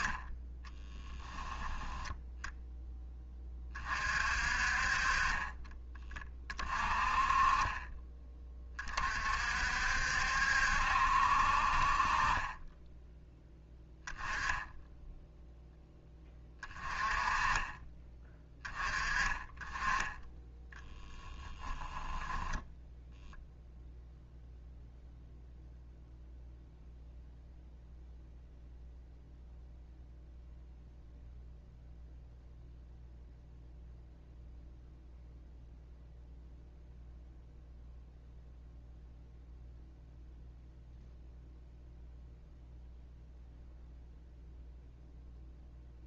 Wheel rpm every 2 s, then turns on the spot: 10, 0, 40, 30, 30, 70, 20, 10, 30, 20, 10, 0, 0, 0, 0, 0, 0, 0, 0, 0, 0, 0, 0.
20-22